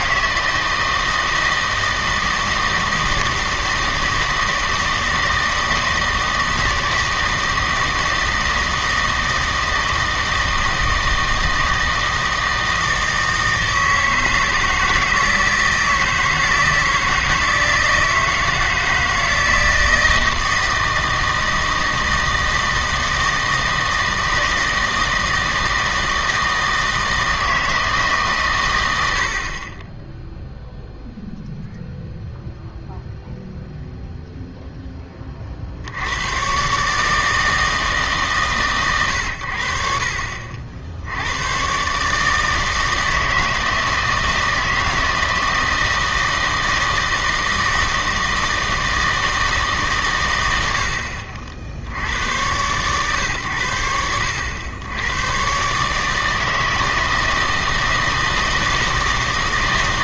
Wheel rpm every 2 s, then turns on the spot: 160, 160, 160, 160, 160, 160, 160, 160, 160, 160, 160, 160, 160, 160, 100, 0, 0, 0, 130, 130, 60, 160, 160, 160, 160, 80, 110, 90, 160, 160.
none